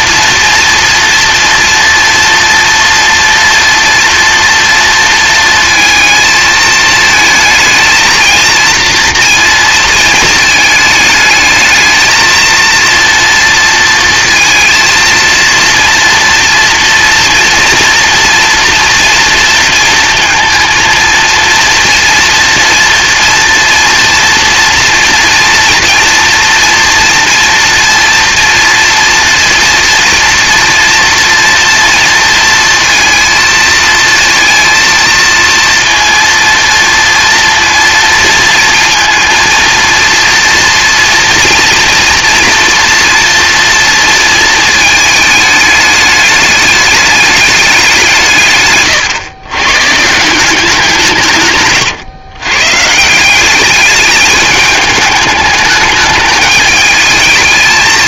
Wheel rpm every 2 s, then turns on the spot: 230, 230, 230, 220, 230, 220, 230, 230, 230, 240, 230, 230, 230, 230, 230, 230, 230, 230, 230, 230, 230, 240, 220, 210, 130, 180, 130, 210, 210.
none